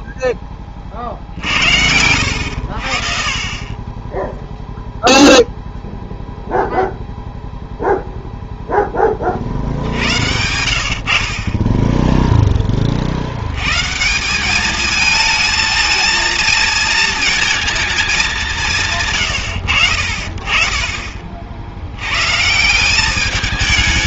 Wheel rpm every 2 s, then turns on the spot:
20, 70, 0, 0, 0, 80, 20, 200, 230, 180, 30, 160.
none